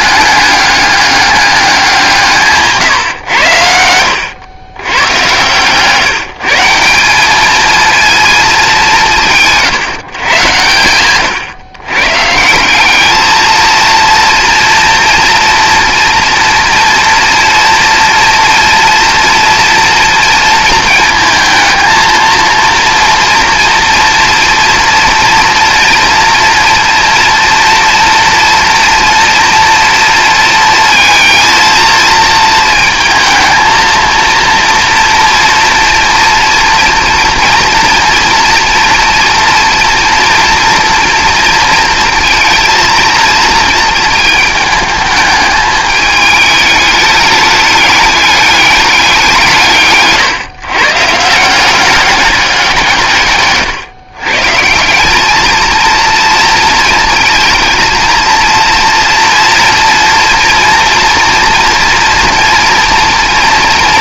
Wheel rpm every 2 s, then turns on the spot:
200, 150, 110, 170, 200, 100, 200, 230, 240, 230, 230, 230, 230, 230, 230, 220, 220, 230, 230, 240, 230, 230, 220, 210, 200, 130, 170, 180, 230, 230, 230, 230.
none